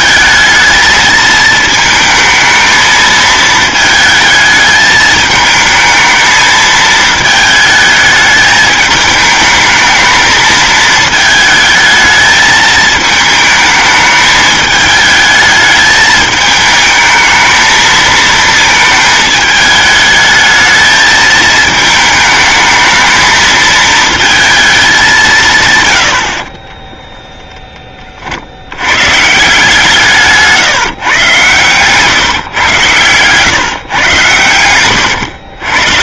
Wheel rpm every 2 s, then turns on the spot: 220, 220, 220, 220, 210, 220, 220, 210, 220, 220, 220, 220, 220, 30, 80, 150, 120, 100.
26-28